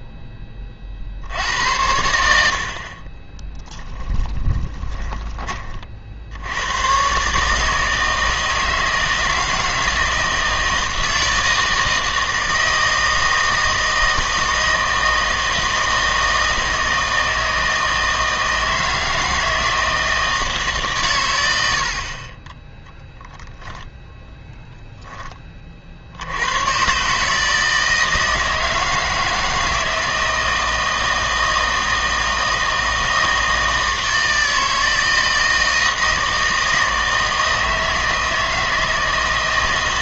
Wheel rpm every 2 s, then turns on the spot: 20, 70, 20, 90, 160, 160, 160, 160, 160, 160, 150, 20, 10, 110, 160, 160, 160, 160, 160, 160.
4-6